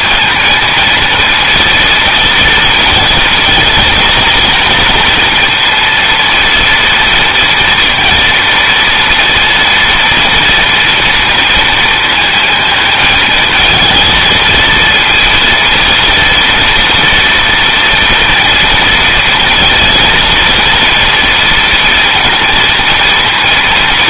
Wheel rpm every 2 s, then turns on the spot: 230, 230, 230, 230, 230, 230, 220, 230, 230, 230, 230, 230.
none